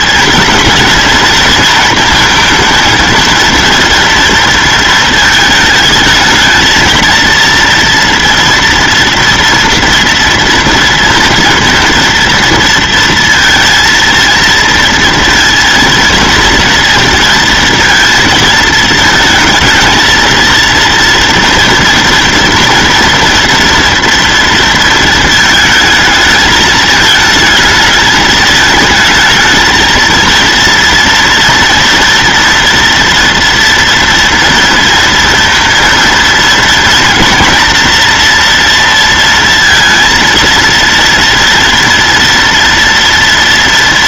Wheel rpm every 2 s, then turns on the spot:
220, 230, 230, 220, 230, 230, 230, 230, 230, 220, 230, 230, 230, 220, 220, 230, 230, 230, 230, 230, 230, 230.
none